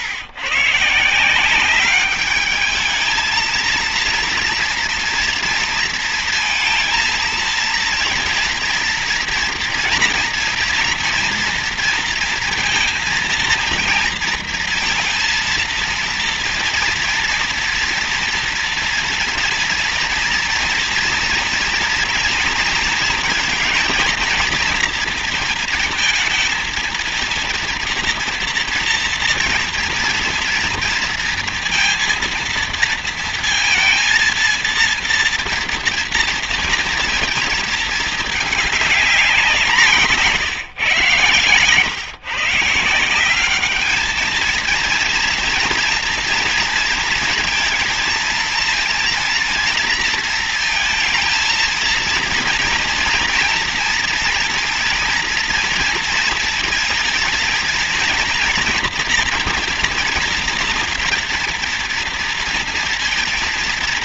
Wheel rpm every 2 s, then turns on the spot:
150, 220, 230, 230, 240, 230, 230, 230, 230, 230, 230, 230, 230, 230, 240, 230, 230, 230, 230, 200, 130, 170, 230, 230, 230, 220, 230, 230, 230, 230, 230, 230.
none